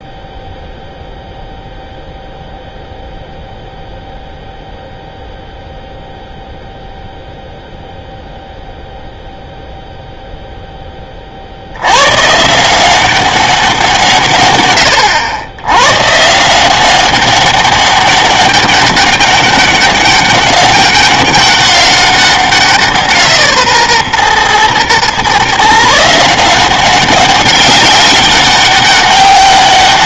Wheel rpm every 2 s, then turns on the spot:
0, 0, 0, 0, 0, 0, 160, 100, 170, 200, 200, 180, 120, 180, 200.
none